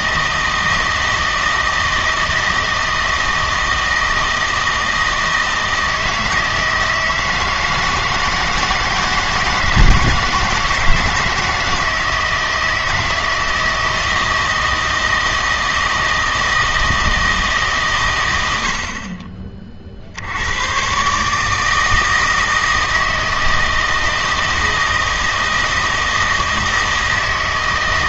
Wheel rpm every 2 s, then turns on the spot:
160, 160, 160, 160, 160, 160, 160, 160, 160, 70, 110, 160, 160, 160.
none